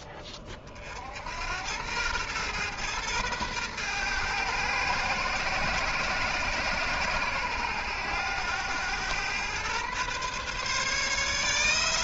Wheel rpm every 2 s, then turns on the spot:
40, 120, 120, 120, 100, 140.
none